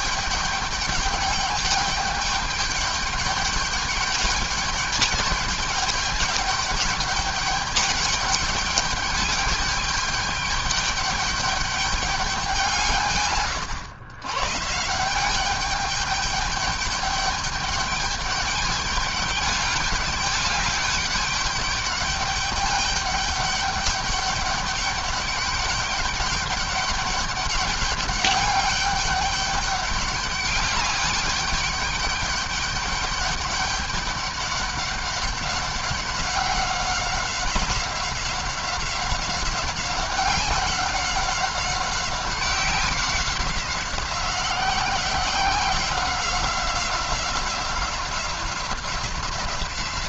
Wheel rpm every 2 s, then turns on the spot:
210, 210, 210, 210, 210, 200, 160, 160, 210, 210, 200, 200, 200, 210, 200, 200, 200, 200, 190, 190, 190, 180, 180, 180, 180.
none